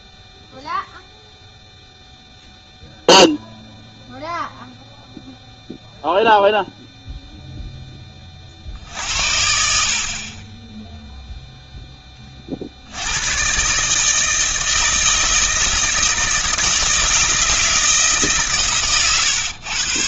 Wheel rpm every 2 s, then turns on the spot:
0, 0, 0, 0, 70, 0, 90, 160, 160, 120.
18-20